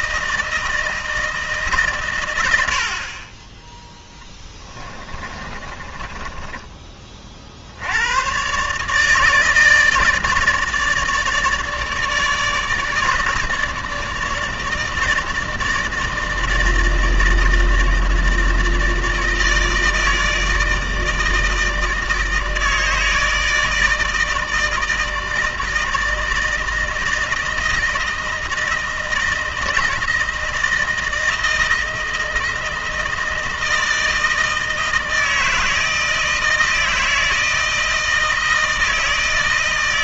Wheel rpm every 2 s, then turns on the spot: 160, 100, 10, 20, 130, 150, 150, 150, 160, 160, 160, 160, 160, 160, 160, 160, 160, 160, 160, 160.
4-6